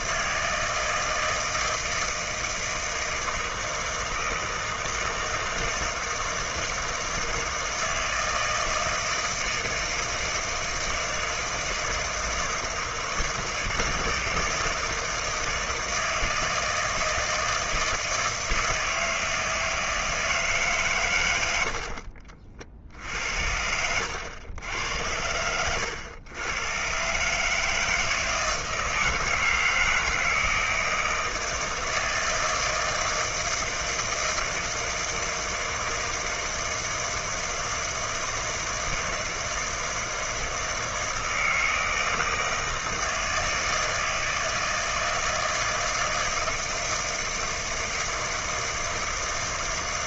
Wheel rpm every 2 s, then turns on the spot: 160, 160, 160, 160, 160, 160, 160, 160, 160, 160, 120, 70, 90, 140, 160, 160, 160, 160, 160, 160, 160, 160, 160, 160, 160.
none